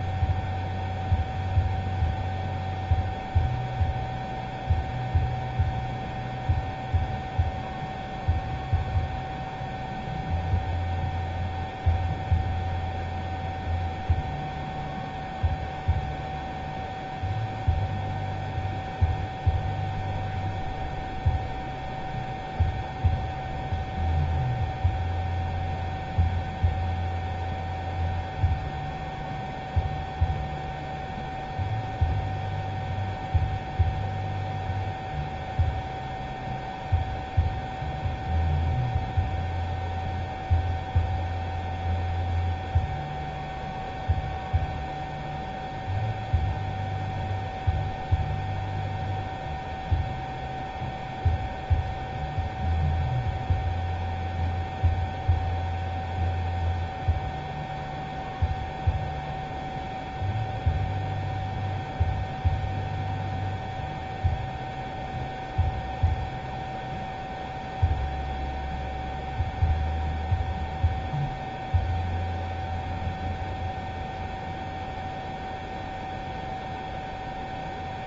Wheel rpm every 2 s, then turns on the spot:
0, 0, 0, 0, 0, 0, 0, 0, 0, 0, 0, 0, 0, 0, 0, 0, 0, 0, 0, 0, 0, 0, 0, 0, 0, 0, 0, 0, 0, 0, 0, 0, 0, 0, 0, 0, 0, 0, 0.
none